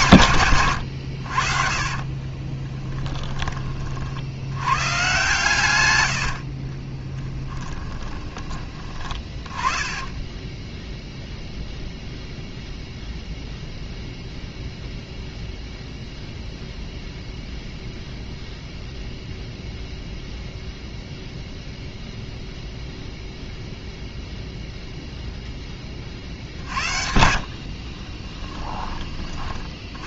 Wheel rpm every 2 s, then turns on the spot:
120, 20, 110, 30, 20, 10, 0, 0, 0, 0, 0, 0, 0, 60, 10.
2-4 6-12 26-28